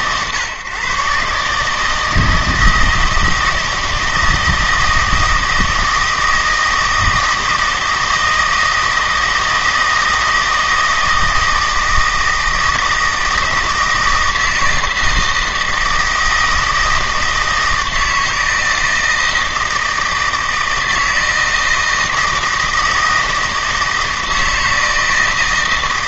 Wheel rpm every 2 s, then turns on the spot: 140, 160, 160, 160, 160, 160, 160, 170, 160, 160, 160, 160, 160.
none